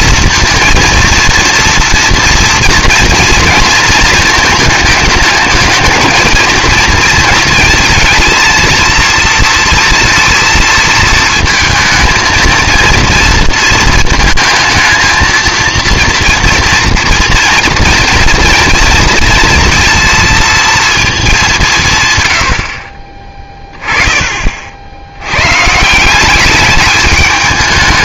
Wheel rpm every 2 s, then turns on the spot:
220, 230, 220, 230, 230, 230, 230, 230, 230, 230, 230, 60, 50, 210.
none